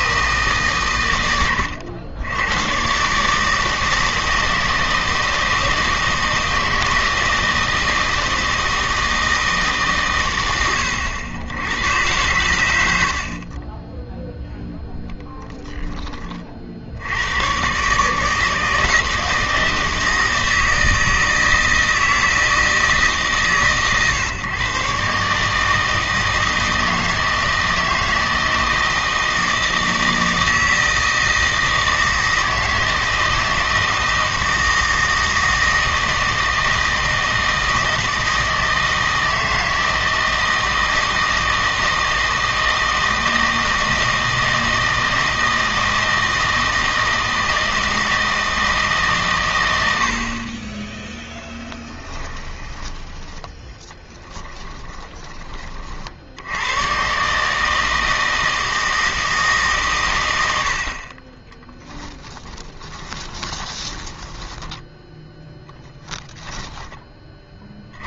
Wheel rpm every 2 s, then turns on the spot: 140, 110, 160, 160, 160, 100, 90, 0, 60, 160, 160, 160, 140, 160, 160, 160, 160, 160, 160, 160, 160, 160, 160, 160, 150, 20, 20, 20, 110, 160, 60, 10, 10, 10.
54-56 62-64